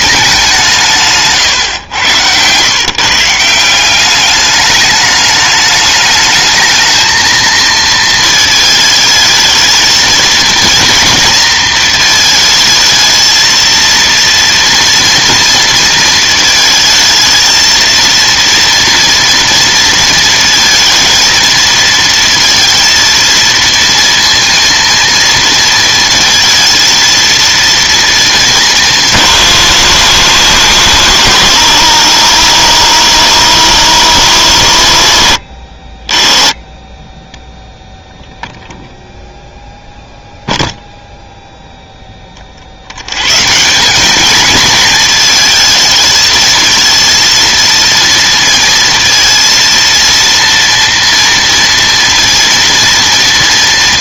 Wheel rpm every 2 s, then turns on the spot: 180, 140, 210, 220, 220, 230, 220, 230, 220, 230, 230, 230, 230, 230, 200, 120, 100, 90, 20, 0, 0, 50, 220, 220, 230, 230, 230.
none